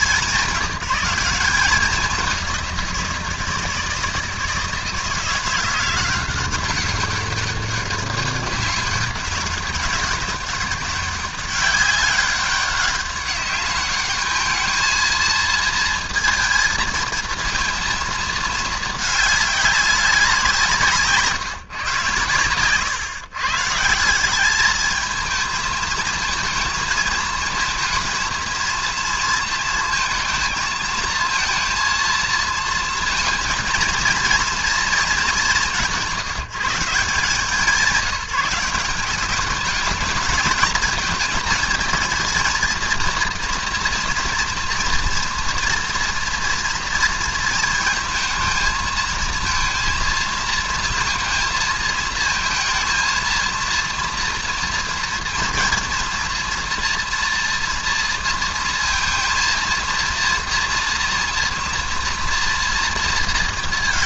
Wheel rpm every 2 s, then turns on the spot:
200, 190, 160, 180, 190, 190, 190, 220, 230, 220, 180, 120, 200, 220, 230, 220, 230, 230, 170, 170, 220, 230, 230, 230, 230, 230, 220, 230, 240, 230, 240, 230.
none